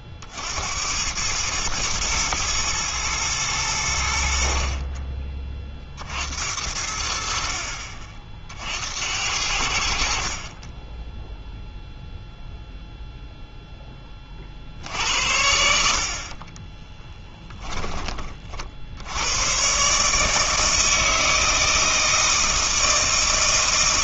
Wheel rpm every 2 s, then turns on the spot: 80, 110, 50, 70, 60, 20, 0, 60, 20, 50, 160, 160.
16-18